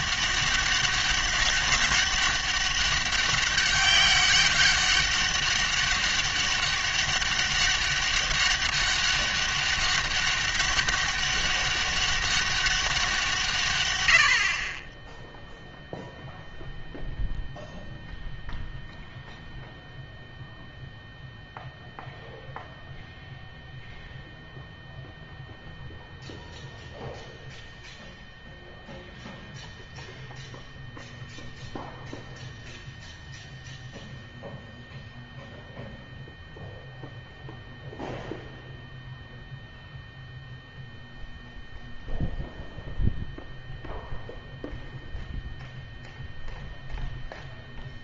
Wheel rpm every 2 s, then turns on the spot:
200, 200, 200, 200, 200, 200, 200, 40, 0, 0, 0, 0, 0, 0, 0, 0, 0, 0, 0, 0, 0, 0, 0, 0.
none